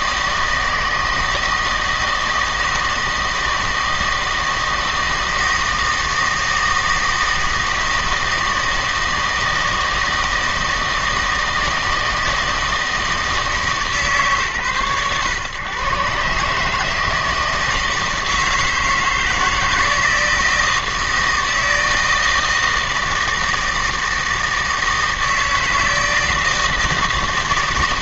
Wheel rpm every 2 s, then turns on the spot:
160, 160, 160, 160, 160, 160, 160, 120, 150, 160, 160, 160, 160, 160.
none